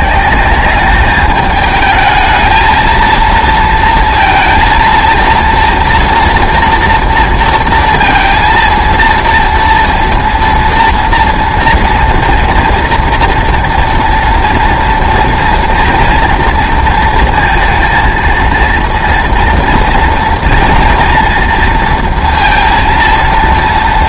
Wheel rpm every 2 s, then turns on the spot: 200, 220, 230, 230, 230, 240, 240, 230, 230, 230, 230, 230.
none